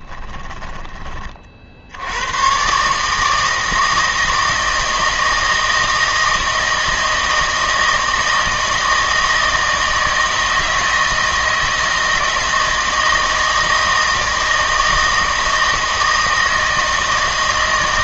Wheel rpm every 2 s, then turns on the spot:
10, 130, 160, 160, 160, 160, 160, 160, 160.
0-2